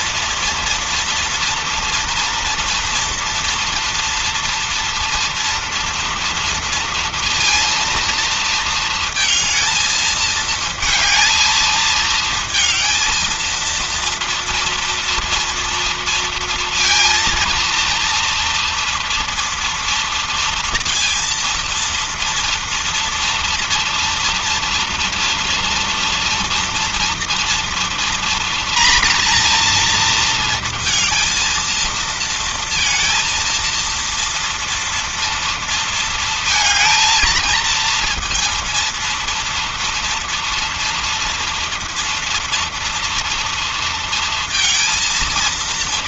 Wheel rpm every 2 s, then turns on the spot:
230, 230, 230, 230, 230, 220, 220, 230, 230, 230, 230, 230, 230, 230, 230, 230, 230, 230, 220, 230, 230, 230, 230.
none